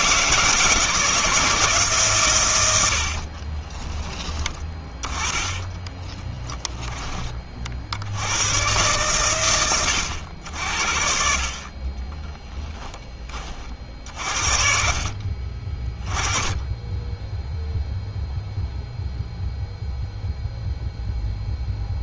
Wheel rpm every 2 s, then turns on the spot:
160, 90, 20, 10, 120, 70, 10, 60, 20, 0, 0.
none